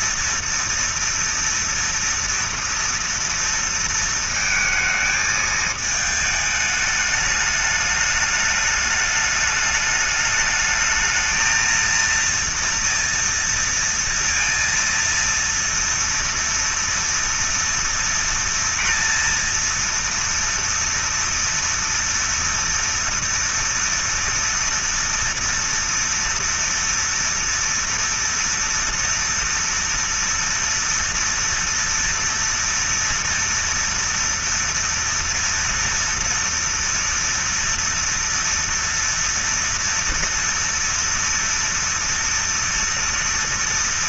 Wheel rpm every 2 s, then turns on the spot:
230, 230, 230, 210, 210, 210, 230, 230, 230, 230, 240, 240, 240, 230, 230, 230, 230, 230, 230, 230, 230, 230.
none